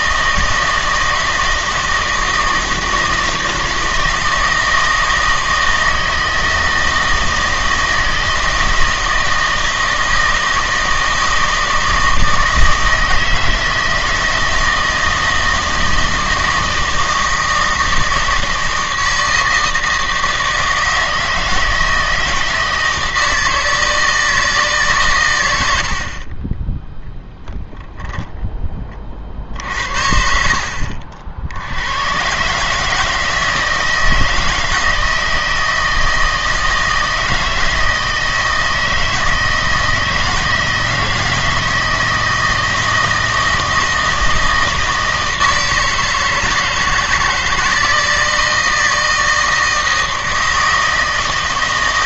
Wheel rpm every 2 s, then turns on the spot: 160, 160, 160, 160, 160, 160, 160, 160, 160, 160, 160, 160, 140, 0, 20, 60, 150, 160, 160, 160, 160, 160, 160, 160, 160, 160.
none